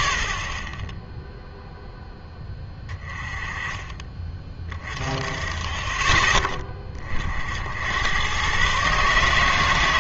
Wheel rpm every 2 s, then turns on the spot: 20, 10, 30, 30, 140.
none